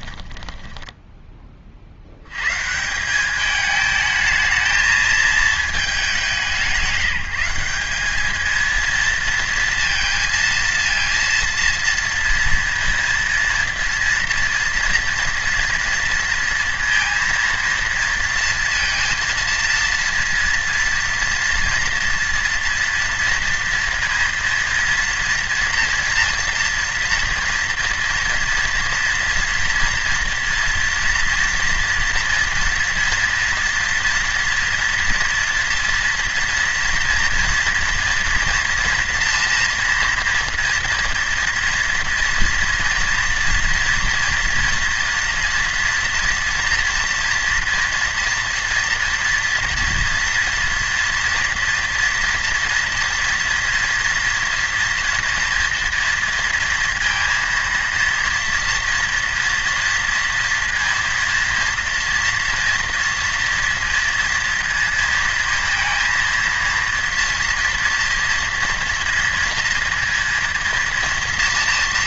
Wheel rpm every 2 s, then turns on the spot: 10, 120, 220, 180, 220, 230, 230, 230, 230, 230, 230, 230, 230, 230, 230, 230, 230, 230, 230, 230, 230, 230, 230, 230, 240, 240, 240, 240, 230, 230, 230, 240, 230, 230, 230, 230.
0-2